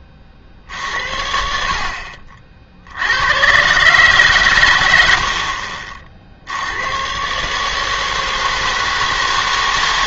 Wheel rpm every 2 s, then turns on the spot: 60, 60, 120, 80, 160.
none